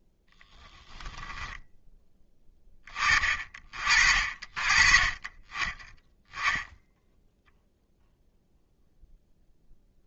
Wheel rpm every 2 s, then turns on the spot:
10, 20, 30, 0, 0.
0-2